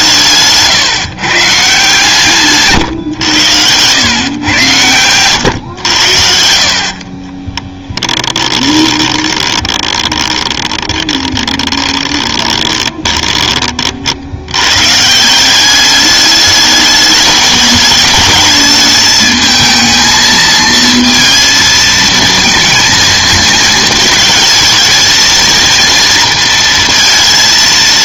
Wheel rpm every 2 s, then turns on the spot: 140, 140, 110, 60, 20, 20, 20, 110, 210, 220, 230, 220, 220, 230.
8-14